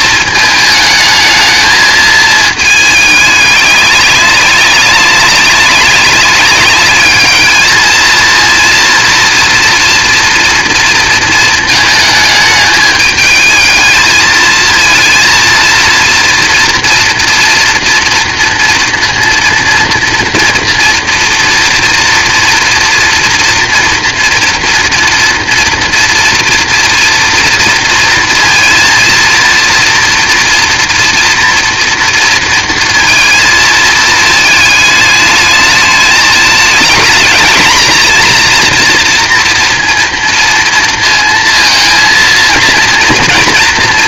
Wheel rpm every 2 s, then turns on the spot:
220, 210, 200, 210, 230, 230, 210, 230, 230, 240, 230, 240, 230, 230, 230, 230, 230, 210, 220, 230, 230, 230.
none